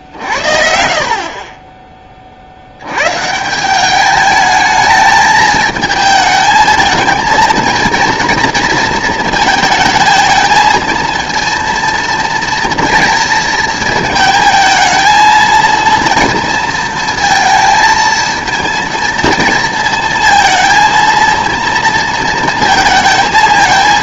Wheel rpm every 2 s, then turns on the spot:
80, 60, 210, 220, 230, 220, 230, 220, 230, 230, 230, 220.
none